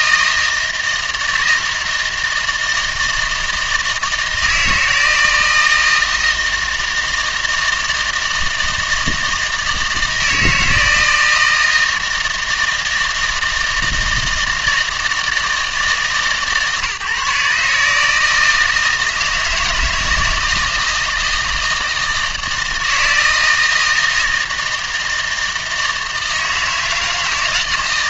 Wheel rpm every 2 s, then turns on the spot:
160, 160, 170, 160, 160, 160, 160, 160, 150, 160, 160, 160, 160, 160.
none